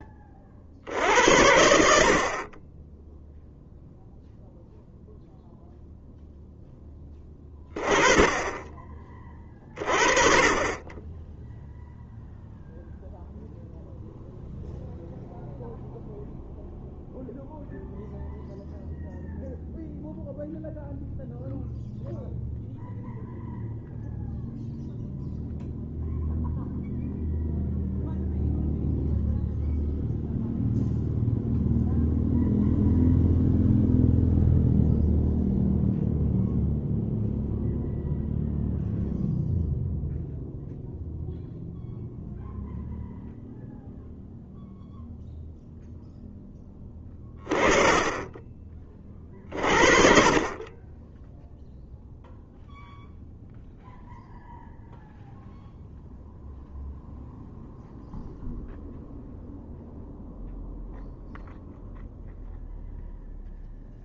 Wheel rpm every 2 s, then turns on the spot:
60, 20, 0, 10, 20, 20, 0, 0, 0, 0, 0, 0, 0, 0, 0, 0, 0, 0, 0, 0, 0, 0, 0, 20, 30, 20, 0, 0, 0, 0, 0, 0.
none